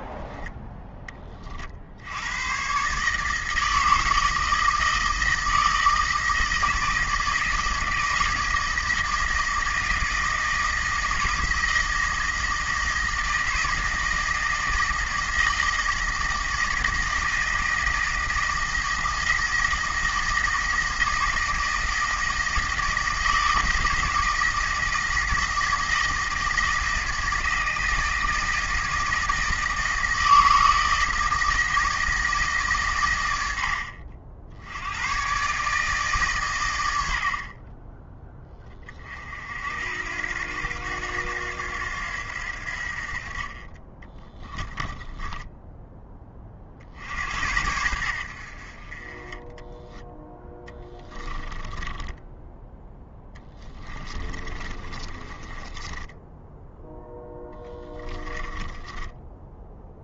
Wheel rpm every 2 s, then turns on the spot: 10, 130, 160, 160, 160, 160, 160, 160, 160, 160, 160, 160, 160, 160, 160, 160, 140, 90, 100, 40, 90, 60, 10, 50, 50, 10, 10, 30, 0, 10.
44-46 50-52 54-56 58-60